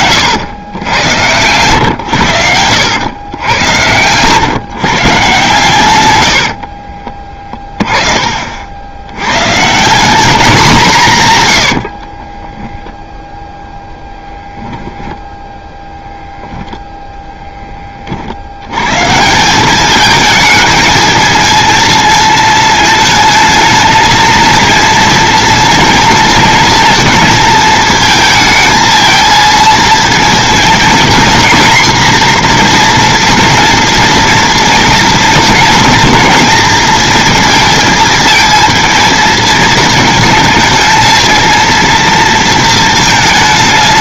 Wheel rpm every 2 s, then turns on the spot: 110, 100, 130, 20, 100, 140, 0, 10, 0, 140, 220, 220, 230, 230, 220, 230, 240, 230, 230, 230, 230, 220.
none